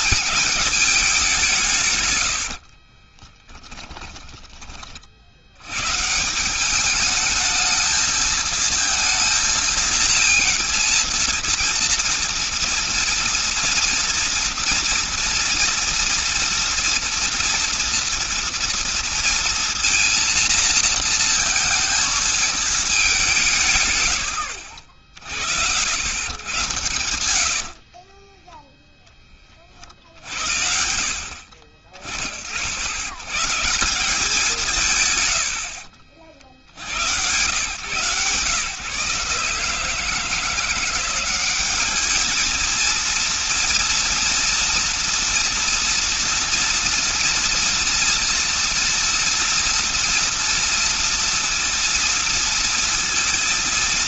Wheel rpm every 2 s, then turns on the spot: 200, 30, 50, 200, 230, 230, 230, 230, 230, 230, 230, 200, 60, 100, 0, 50, 90, 130, 80, 150, 180, 230, 230, 230, 230, 230, 230.
2-4 26-28 34-36